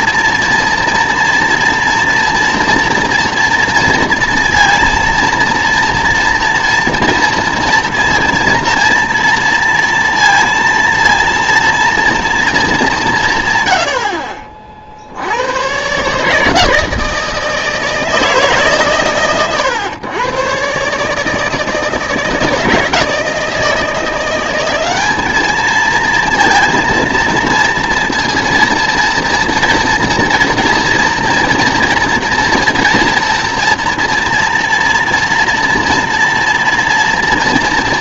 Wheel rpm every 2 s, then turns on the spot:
230, 230, 230, 230, 230, 230, 210, 40, 160, 150, 130, 160, 190, 230, 230, 240, 230, 230, 230.
none